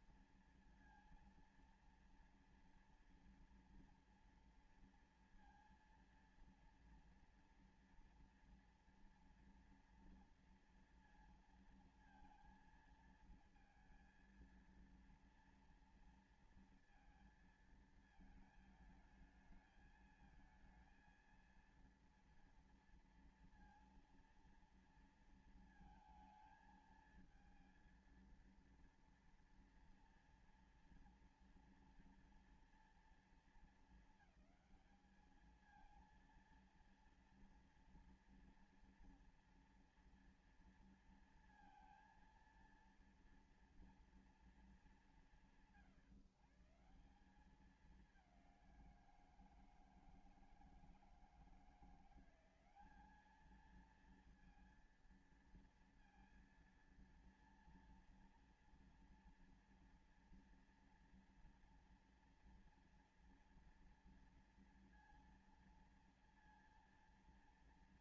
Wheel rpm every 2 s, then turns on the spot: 230, 230, 230, 230, 230, 230, 230, 230, 230, 220, 220, 230, 230, 220, 230, 230, 230, 220, 230, 240, 230, 230, 200, 150, 190, 160, 180, 230, 230, 230, 240, 230, 230, 230.
none